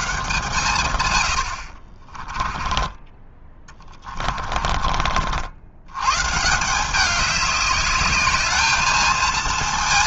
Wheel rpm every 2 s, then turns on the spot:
120, 20, 40, 170, 220.
2-6